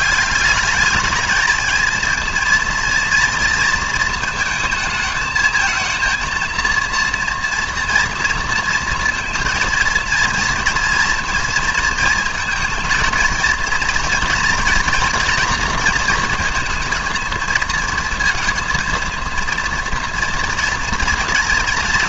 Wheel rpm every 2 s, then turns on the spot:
210, 230, 220, 230, 230, 230, 220, 230, 230, 230, 230.
none